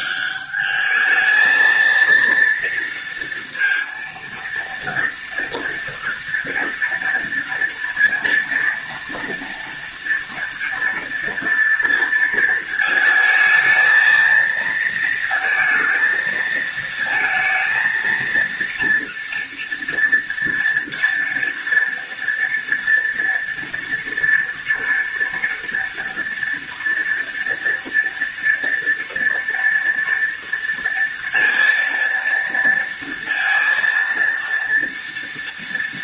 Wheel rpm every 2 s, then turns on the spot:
200, 230, 230, 230, 230, 230, 230, 230, 230, 230, 230, 230, 230, 230, 230, 230, 230, 230.
none